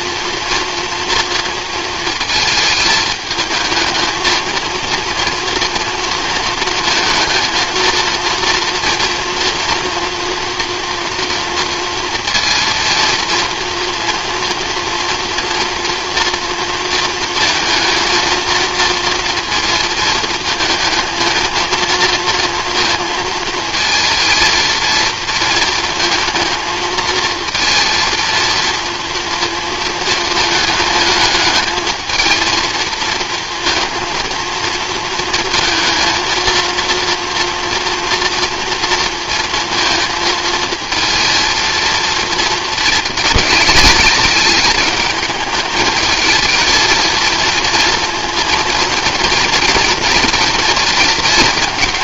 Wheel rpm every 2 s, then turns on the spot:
230, 220, 230, 220, 240, 240, 230, 230, 230, 230, 220, 230, 230, 230, 230, 220, 230, 230, 230, 230, 230, 220, 210, 220, 230, 230.
none